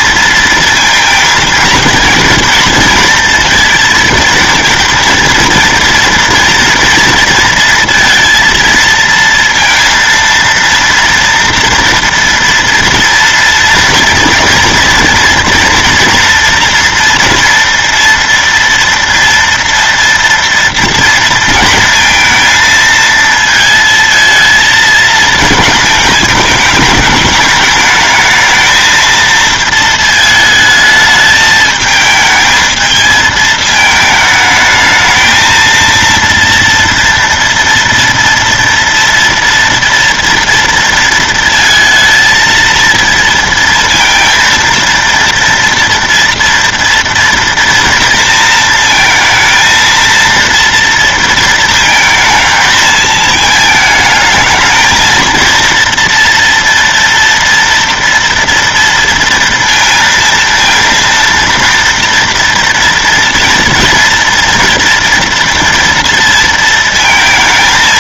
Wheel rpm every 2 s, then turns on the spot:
230, 230, 230, 230, 230, 230, 230, 240, 230, 230, 240, 230, 220, 210, 220, 220, 220, 220, 230, 230, 230, 230, 230, 230, 230, 230, 220, 220, 230, 230, 230, 230, 230, 230.
none